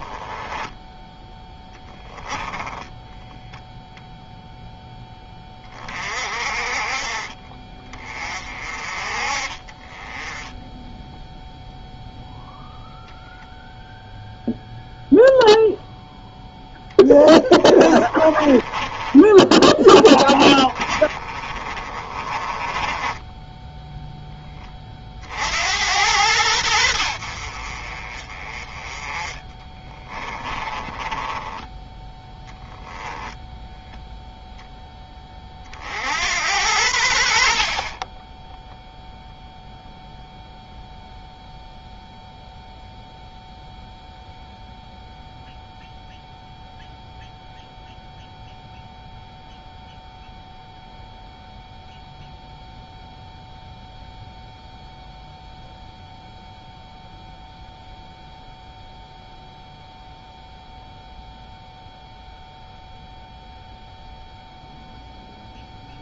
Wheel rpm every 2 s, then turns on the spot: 10, 10, 10, 40, 40, 10, 0, 0, 10, 20, 30, 20, 40, 70, 20, 20, 0, 10, 80, 0, 0, 0, 0, 0, 0, 0, 0, 0, 0, 0, 0, 0, 0.
0-4 16-24 30-32